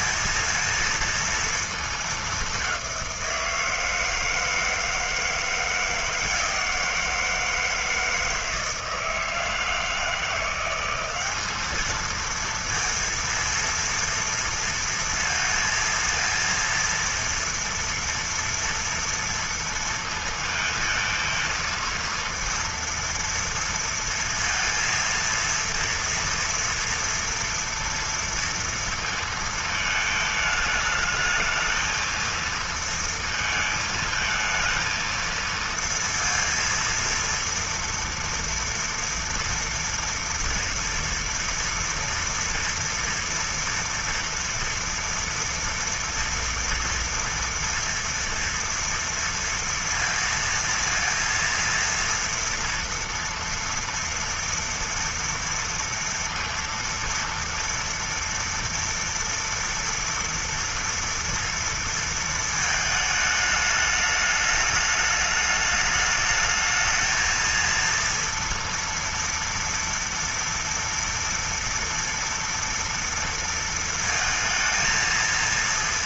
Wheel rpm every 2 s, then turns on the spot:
230, 190, 160, 170, 160, 190, 230, 230, 230, 230, 220, 230, 230, 230, 230, 220, 230, 230, 230, 230, 230, 240, 230, 230, 230, 230, 230, 230, 230, 230, 230, 220, 210, 220, 230, 230, 230, 230.
none